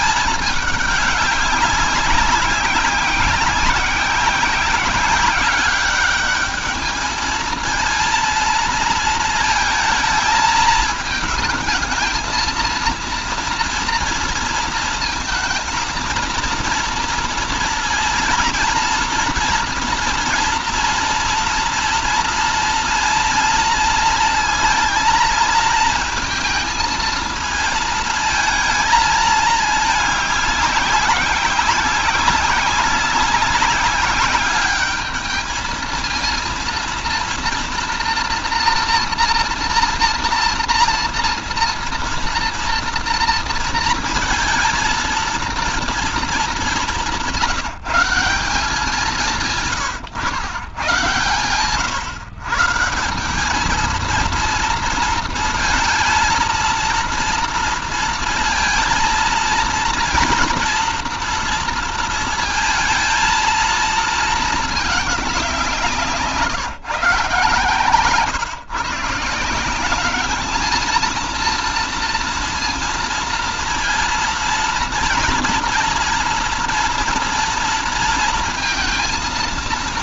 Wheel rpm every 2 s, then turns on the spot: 210, 190, 190, 210, 230, 220, 230, 230, 230, 220, 230, 230, 230, 220, 220, 190, 190, 210, 230, 230, 230, 230, 230, 210, 180, 110, 130, 220, 230, 230, 230, 220, 220, 160, 140, 220, 230, 230, 230, 230.
none